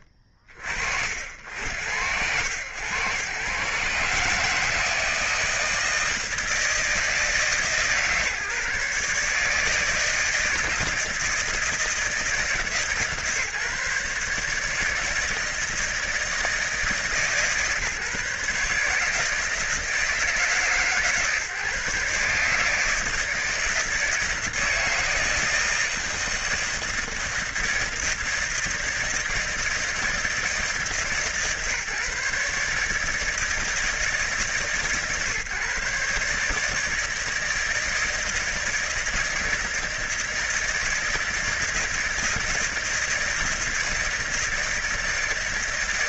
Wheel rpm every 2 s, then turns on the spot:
40, 110, 150, 160, 150, 160, 160, 160, 160, 150, 150, 150, 160, 160, 160, 160, 150, 140, 150, 160, 160, 160, 160.
none